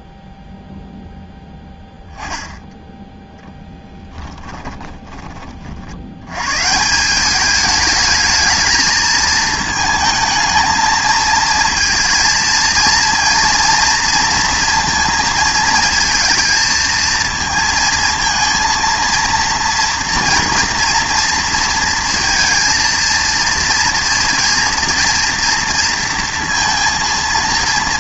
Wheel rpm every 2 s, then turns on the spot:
0, 0, 10, 130, 220, 220, 230, 230, 230, 230, 230, 230, 230, 230.
4-6